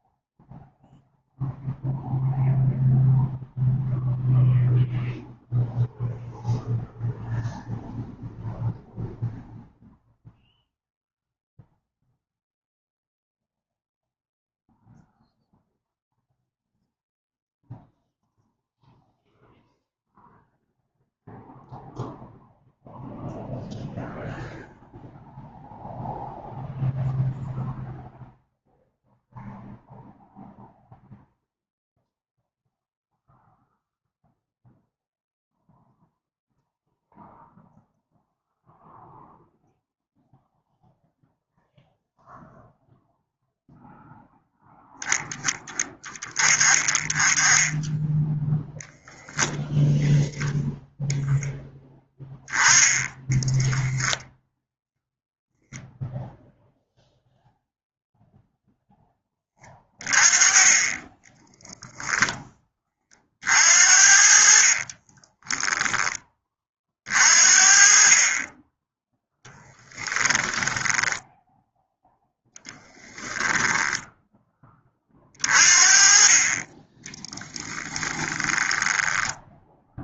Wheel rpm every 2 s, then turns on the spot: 0, 0, 0, 0, 0, 0, 0, 0, 0, 0, 0, 0, 0, 0, 0, 0, 0, 0, 0, 0, 0, 0, 10, 20, 0, 0, 10, 0, 0, 10, 20, 30, 30, 40, 10, 10, 20, 30, 10, 10.
64-66 78-80